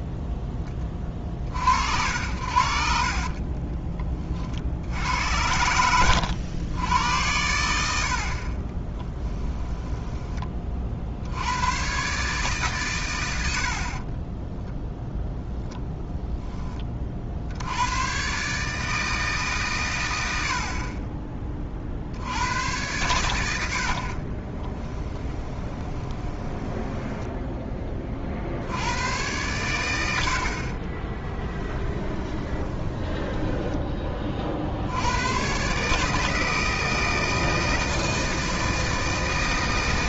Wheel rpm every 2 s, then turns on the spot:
10, 60, 50, 90, 30, 30, 130, 10, 20, 150, 50, 100, 20, 10, 70, 50, 20, 60, 160, 160.
8-10 24-28 30-34